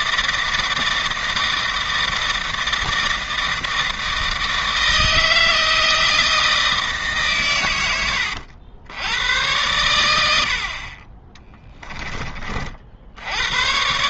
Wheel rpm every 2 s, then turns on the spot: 160, 160, 160, 150, 90, 40, 50.
none